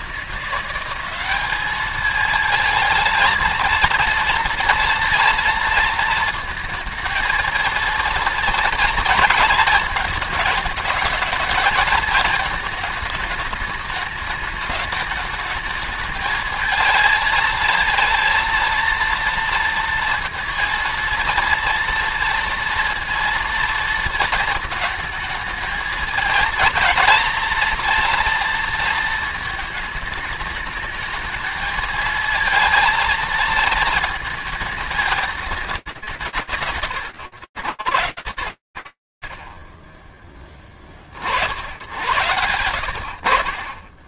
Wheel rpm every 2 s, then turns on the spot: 180, 220, 230, 220, 230, 220, 220, 210, 220, 230, 230, 230, 220, 220, 230, 210, 230, 220, 130, 20, 110, 10.
none